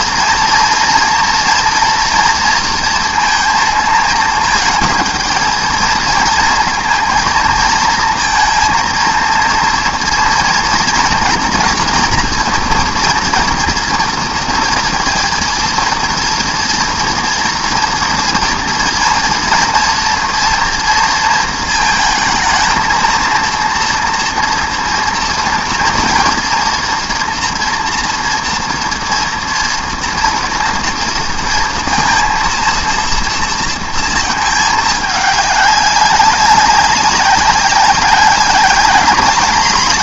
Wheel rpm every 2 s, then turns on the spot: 230, 230, 220, 220, 230, 230, 230, 230, 230, 240, 230, 230, 230, 240, 230, 240, 230, 210, 200, 200.
none